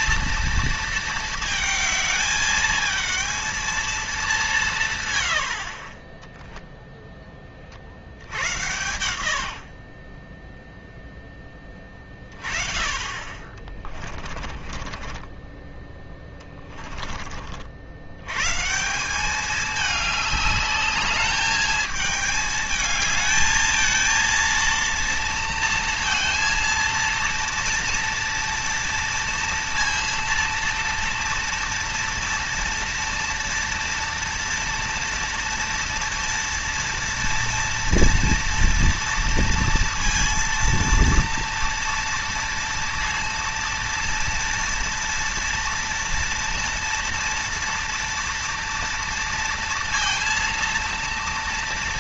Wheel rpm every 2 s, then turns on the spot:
230, 210, 170, 0, 90, 10, 20, 40, 20, 140, 210, 220, 230, 230, 230, 230, 230, 230, 230, 230, 230, 230, 230, 230, 230, 230.
14-18